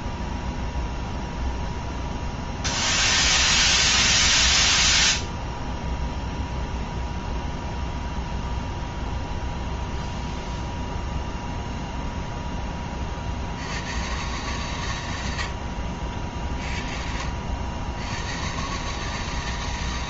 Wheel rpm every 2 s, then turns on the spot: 0, 0, 0, 0, 0, 0, 10, 120, 40, 120.
none